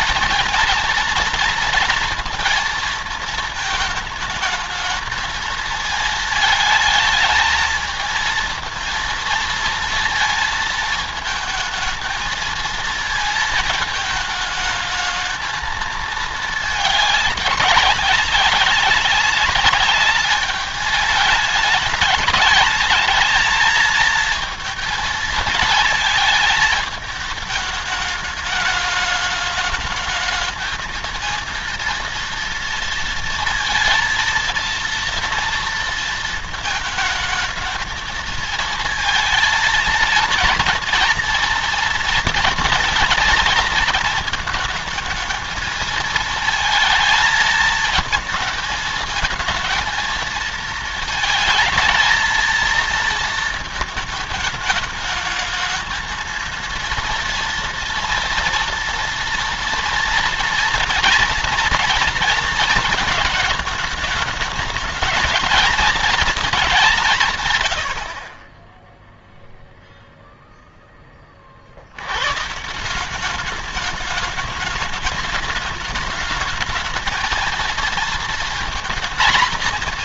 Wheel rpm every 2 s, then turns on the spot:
230, 230, 210, 220, 230, 220, 220, 210, 210, 190, 210, 210, 220, 220, 210, 220, 230, 230, 220, 220, 230, 230, 230, 230, 220, 220, 230, 220, 230, 230, 230, 230, 210, 210, 30, 0, 140, 210, 220, 230.
none